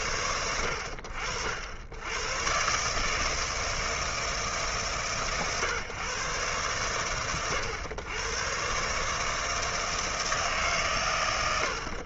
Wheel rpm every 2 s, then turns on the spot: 100, 160, 130, 130, 160, 100.
none